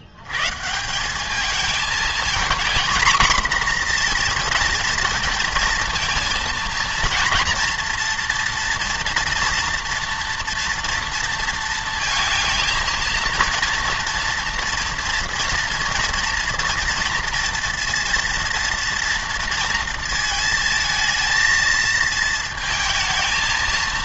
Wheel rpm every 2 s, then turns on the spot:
150, 240, 230, 230, 240, 230, 230, 240, 230, 230, 220, 220.
none